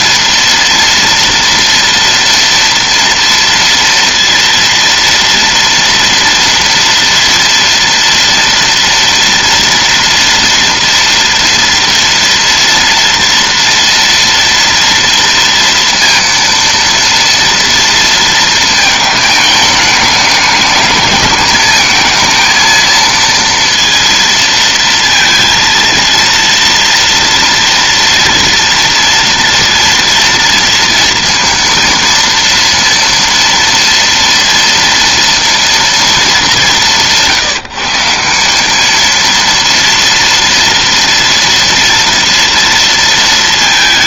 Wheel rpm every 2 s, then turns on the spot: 230, 230, 230, 230, 230, 240, 230, 230, 230, 220, 210, 230, 230, 230, 230, 230, 230, 230, 180, 220, 230, 230.
none